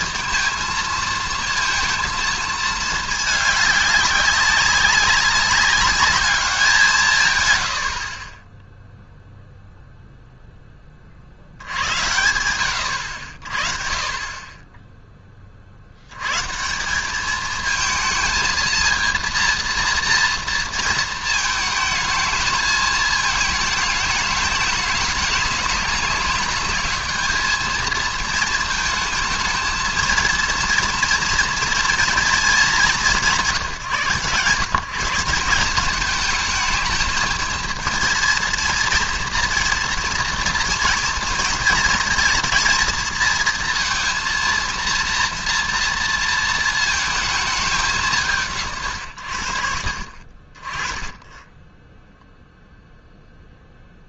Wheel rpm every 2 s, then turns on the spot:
230, 220, 200, 190, 10, 0, 90, 20, 140, 220, 230, 220, 210, 200, 220, 230, 220, 150, 220, 230, 230, 230, 230, 230, 150, 40, 0.
none